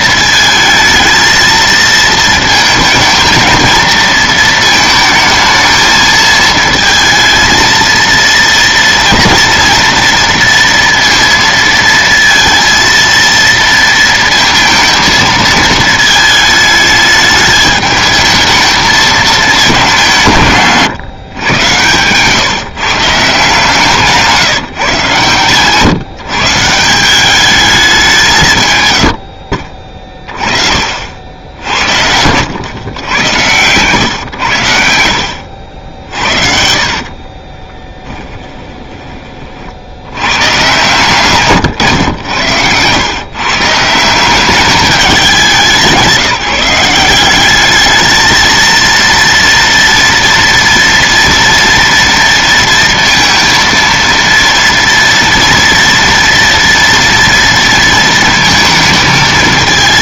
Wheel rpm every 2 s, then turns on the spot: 220, 220, 220, 220, 230, 230, 230, 220, 220, 220, 160, 140, 160, 150, 160, 30, 100, 100, 50, 10, 110, 100, 190, 160, 220, 230, 230, 230, 230, 230.
36-40